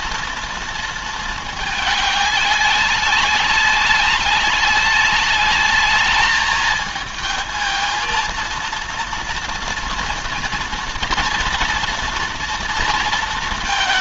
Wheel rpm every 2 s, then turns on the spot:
220, 200, 200, 220, 230, 230, 230.
none